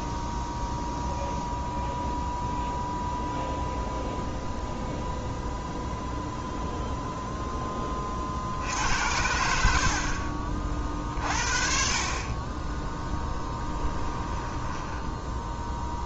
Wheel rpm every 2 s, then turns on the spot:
0, 0, 0, 0, 80, 40, 10, 10.
14-16